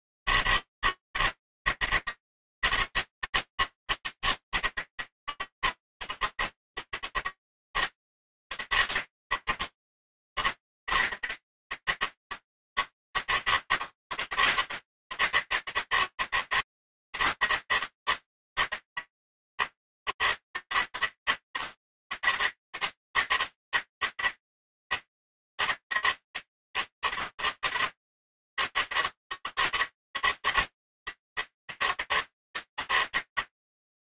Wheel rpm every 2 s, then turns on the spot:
160, 160, 160, 160, 160, 150, 160, 160, 160, 150, 150, 160, 160, 160, 150, 140, 140.
none